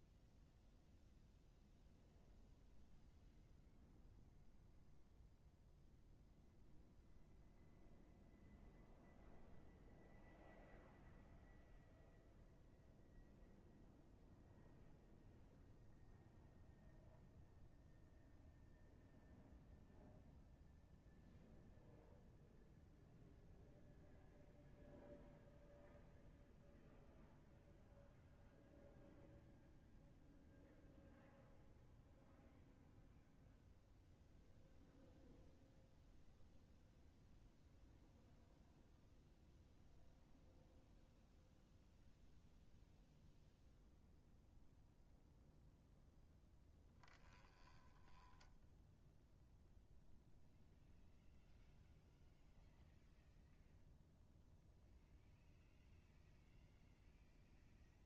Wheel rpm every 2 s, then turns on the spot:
0, 0, 0, 0, 0, 0, 0, 0, 0, 0, 0, 0, 0, 0, 0, 0, 0, 0, 0, 0, 0, 0, 0, 10, 10, 0, 0, 0, 0.
48-50